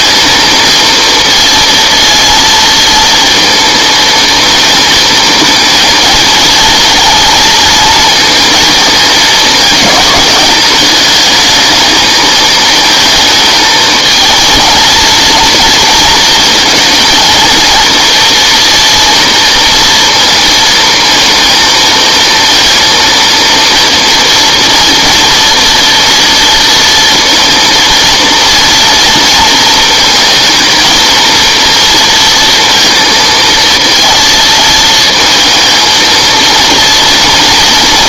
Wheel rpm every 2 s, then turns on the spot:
230, 220, 220, 230, 220, 210, 220, 220, 230, 230, 230, 230, 230, 230, 230, 220, 230, 230, 230.
none